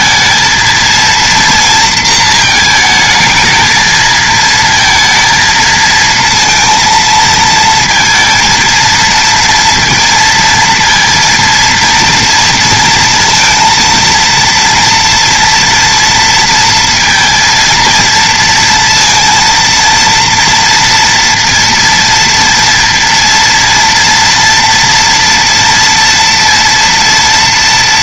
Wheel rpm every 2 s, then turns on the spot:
230, 220, 230, 230, 230, 230, 230, 240, 230, 230, 230, 230, 230, 230.
none